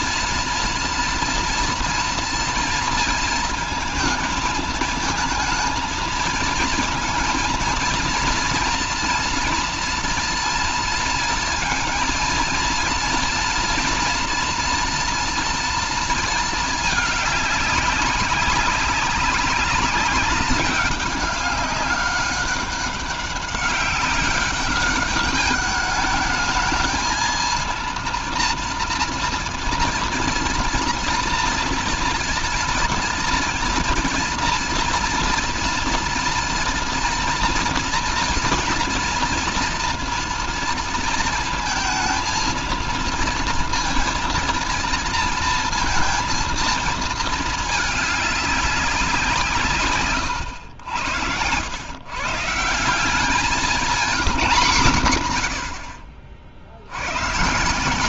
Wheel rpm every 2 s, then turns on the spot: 230, 230, 220, 220, 230, 230, 230, 230, 220, 200, 200, 200, 200, 220, 230, 240, 230, 230, 230, 230, 230, 230, 230, 220, 190, 100, 170, 160, 60.
none